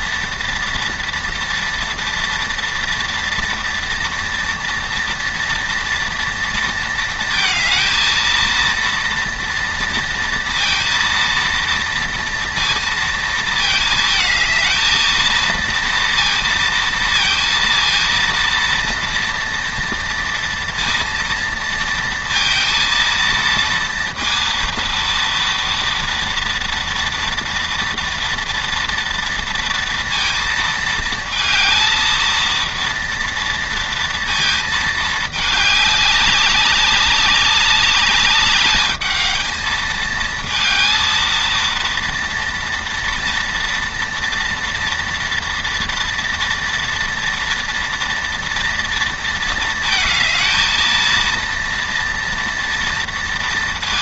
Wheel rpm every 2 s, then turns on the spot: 230, 230, 230, 220, 230, 230, 230, 230, 230, 230, 230, 230, 230, 230, 230, 220, 230, 210, 200, 220, 230, 230, 230, 230, 230, 230, 230.
none